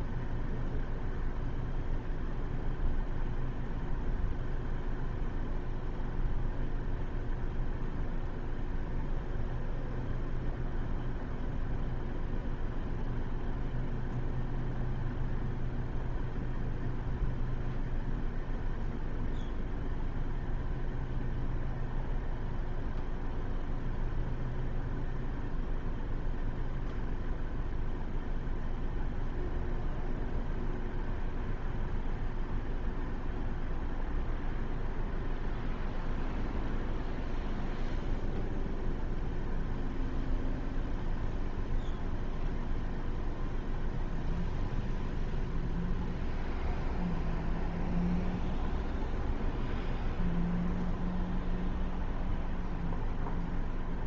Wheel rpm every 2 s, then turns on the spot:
0, 0, 0, 0, 0, 0, 0, 0, 0, 0, 0, 0, 0, 0, 0, 0, 0, 0, 0, 0, 0, 0, 0, 0, 0, 0, 0.
none